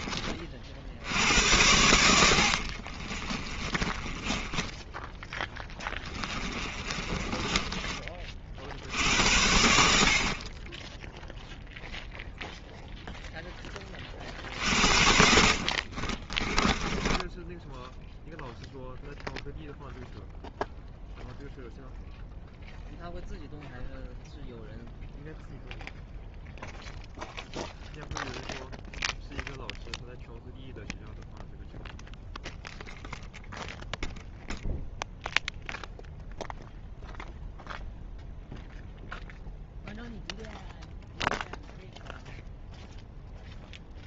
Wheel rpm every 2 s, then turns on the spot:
60, 50, 10, 20, 60, 20, 0, 50, 20, 0, 0, 0, 0, 0, 0, 0, 0, 0, 0, 0, 0, 0.
2-8 14-18